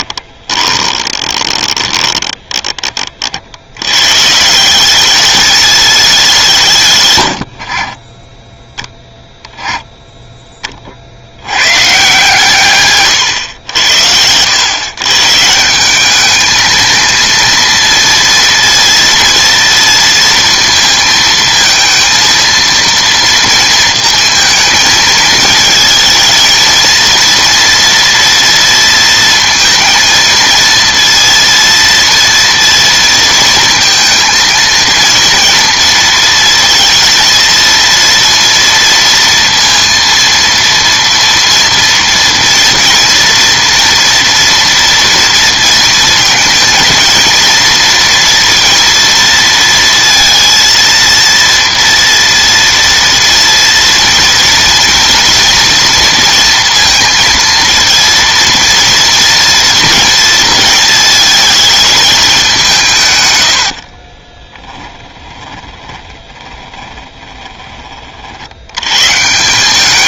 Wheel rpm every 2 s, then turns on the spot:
20, 30, 200, 90, 10, 70, 110, 140, 220, 230, 230, 230, 220, 230, 230, 230, 230, 230, 230, 230, 230, 230, 230, 230, 230, 230, 230, 230, 230, 230, 220, 110, 10, 20, 110.
0-2 12-14 62-68